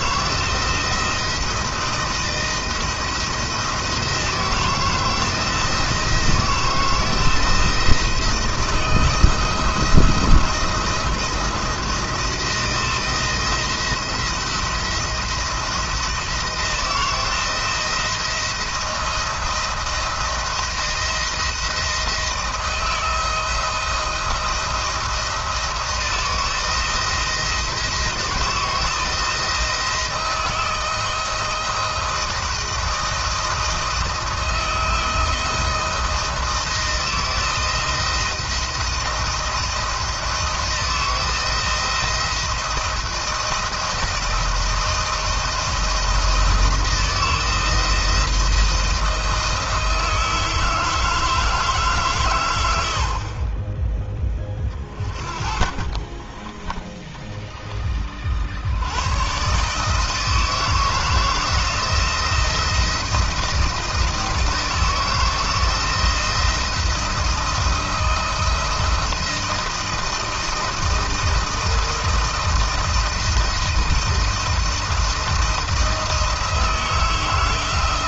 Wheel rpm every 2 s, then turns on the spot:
160, 170, 160, 160, 160, 170, 170, 160, 160, 170, 170, 160, 170, 170, 160, 160, 170, 170, 170, 170, 160, 170, 170, 170, 170, 160, 80, 30, 30, 90, 160, 170, 160, 170, 170, 160, 170, 170, 160.
none